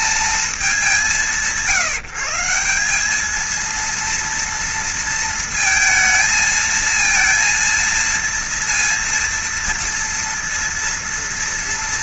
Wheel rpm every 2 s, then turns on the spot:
210, 190, 230, 220, 230, 230.
none